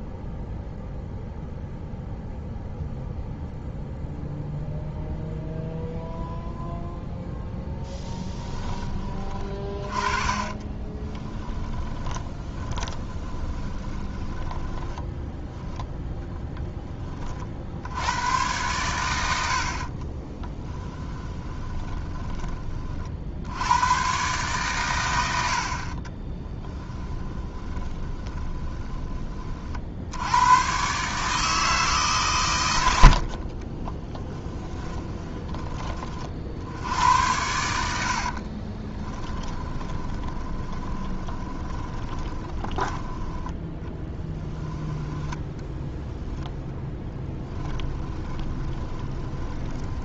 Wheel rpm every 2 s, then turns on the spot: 0, 0, 0, 0, 20, 30, 20, 10, 10, 110, 10, 40, 120, 10, 20, 130, 100, 10, 70, 20, 20, 20, 10, 10, 20.
10-16 20-22 26-28 34-36 38-44 46-50